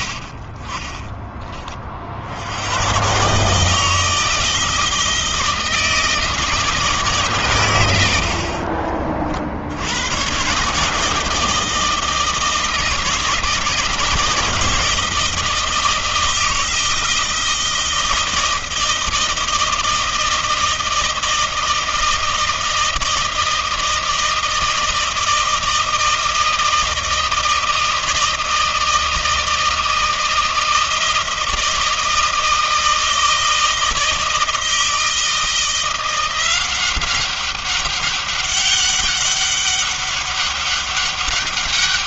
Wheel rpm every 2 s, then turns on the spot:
70, 60, 160, 160, 60, 120, 160, 160, 160, 160, 160, 160, 160, 160, 160, 160, 160, 160, 180, 200, 200.
none